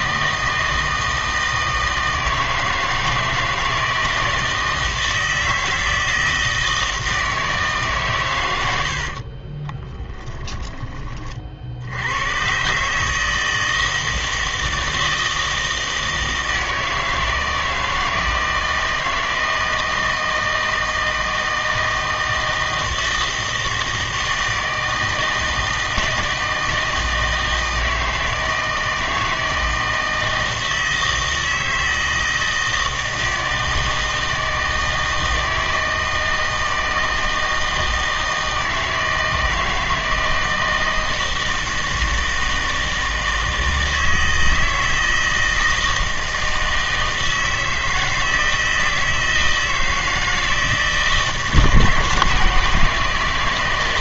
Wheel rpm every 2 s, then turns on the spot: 160, 160, 160, 160, 90, 10, 130, 160, 160, 160, 160, 160, 160, 160, 160, 160, 160, 160, 160, 160, 160, 160, 160, 160, 160, 160, 170.
8-10